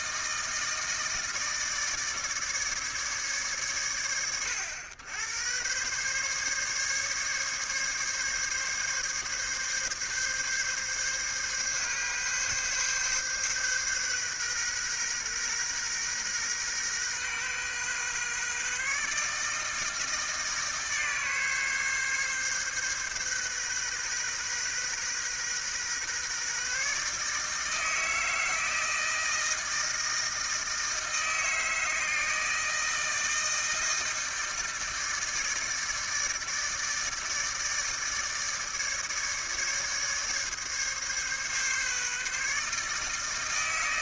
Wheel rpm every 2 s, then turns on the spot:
160, 150, 80, 140, 140, 140, 140, 130, 130, 140, 150, 140, 130, 140, 160, 160, 160, 160, 160, 150, 150, 150.
none